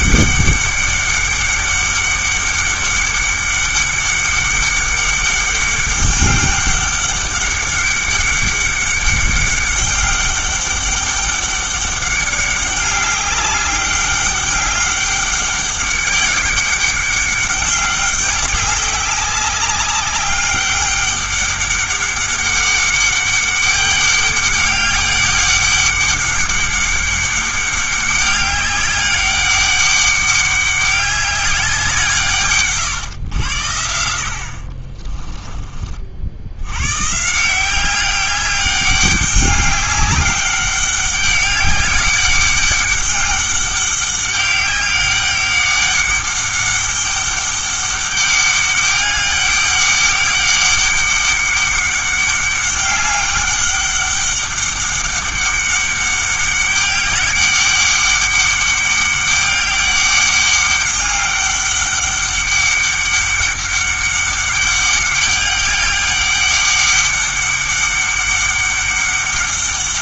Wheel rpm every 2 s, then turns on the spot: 200, 200, 200, 200, 200, 200, 200, 200, 200, 190, 200, 200, 200, 200, 200, 200, 130, 50, 100, 200, 200, 200, 200, 200, 200, 200, 200, 200, 200, 200, 200, 200, 200, 200, 200.
34-36